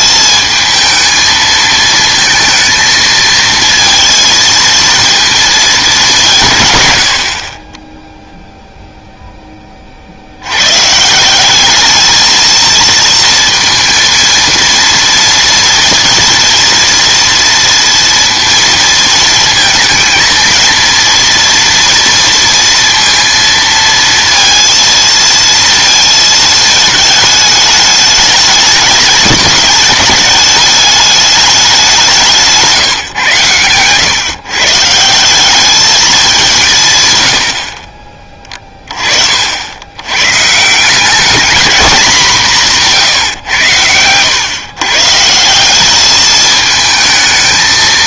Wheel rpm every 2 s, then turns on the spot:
220, 220, 230, 130, 0, 110, 230, 230, 230, 230, 230, 230, 230, 220, 210, 210, 150, 150, 170, 30, 150, 180, 130, 220.
none